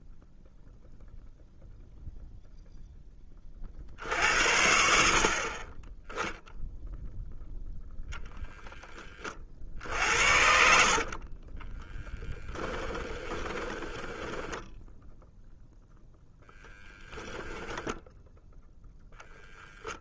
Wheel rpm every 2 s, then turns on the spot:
0, 10, 60, 0, 20, 50, 10, 10, 0, 0.
10-14